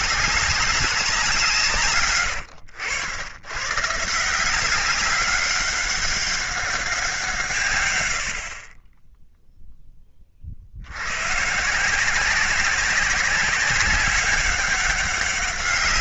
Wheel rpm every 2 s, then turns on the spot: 190, 90, 180, 190, 40, 70, 190, 200.
2-4